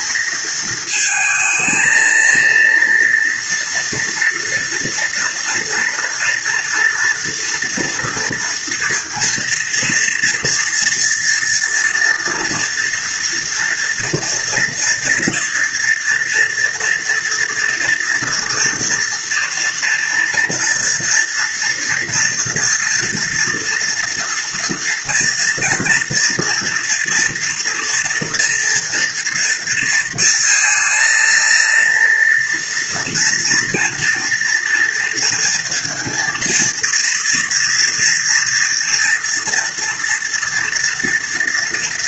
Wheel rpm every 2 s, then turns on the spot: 220, 230, 230, 240, 230, 230, 240, 230, 230, 240, 240, 230, 230, 230, 230, 230, 240, 230, 230, 230, 230.
none